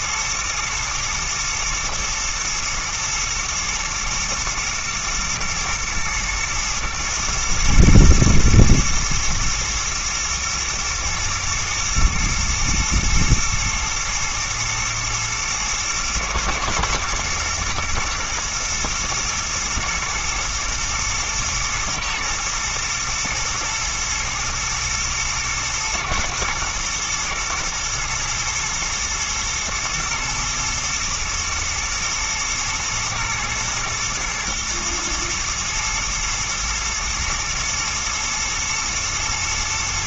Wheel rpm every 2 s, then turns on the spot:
120, 110, 110, 110, 110, 110, 110, 110, 110, 110, 110, 110, 110, 120, 110, 110, 120, 110, 110, 120.
none